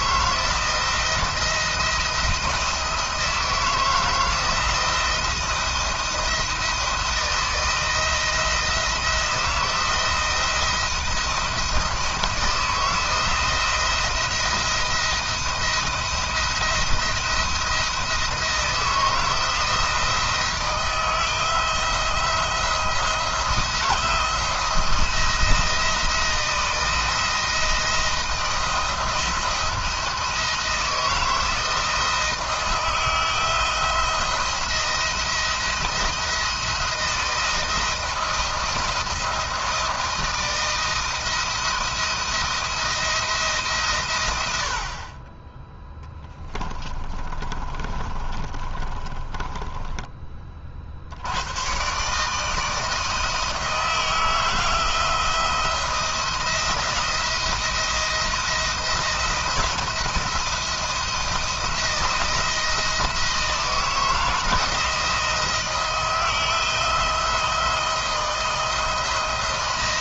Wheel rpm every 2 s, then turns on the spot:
170, 160, 170, 170, 170, 170, 170, 170, 170, 160, 160, 170, 170, 170, 170, 160, 160, 170, 160, 160, 160, 170, 60, 20, 30, 60, 160, 160, 170, 170, 170, 170, 170, 170, 160.
46-50